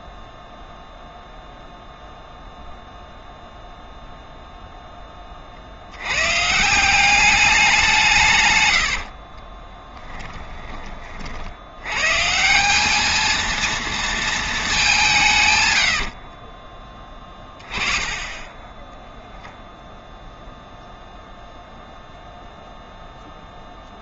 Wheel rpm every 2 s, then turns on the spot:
0, 0, 0, 140, 130, 20, 180, 220, 20, 10, 0, 0.
10-12 16-18